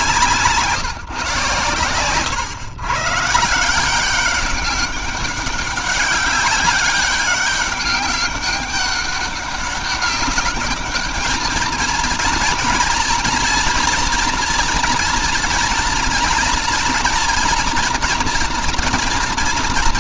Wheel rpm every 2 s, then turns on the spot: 130, 160, 200, 200, 200, 220, 230, 230, 230, 220.
none